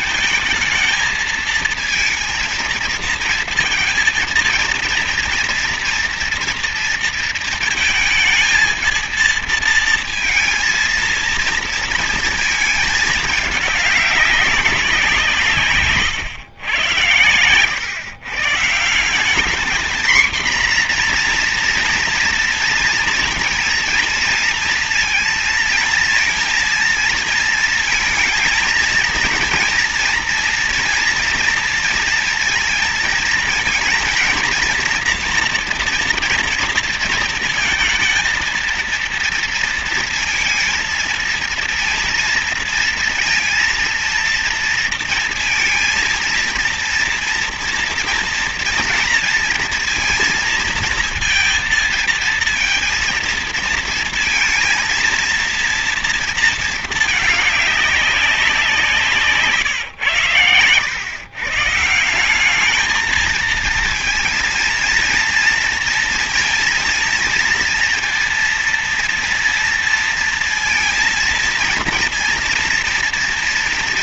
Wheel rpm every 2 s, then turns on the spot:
220, 230, 230, 230, 230, 230, 220, 190, 110, 150, 240, 230, 230, 230, 230, 230, 220, 230, 230, 230, 230, 230, 230, 230, 230, 230, 230, 230, 230, 170, 100, 210, 230, 230, 230, 230, 230.
none